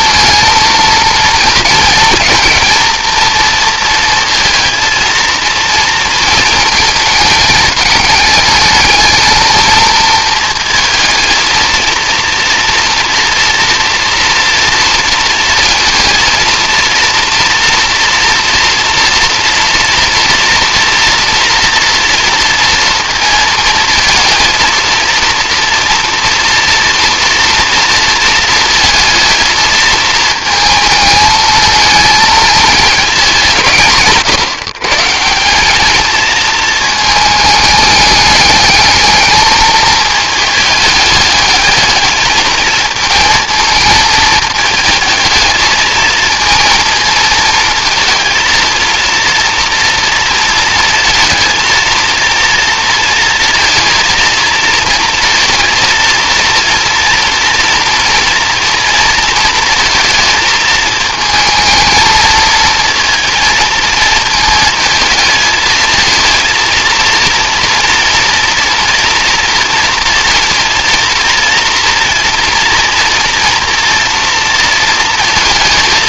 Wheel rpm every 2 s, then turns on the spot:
230, 230, 230, 220, 210, 220, 230, 230, 230, 230, 230, 230, 230, 230, 230, 220, 220, 160, 230, 210, 210, 220, 220, 230, 230, 230, 230, 230, 230, 230, 220, 230, 220, 230, 230, 230, 230, 230.
none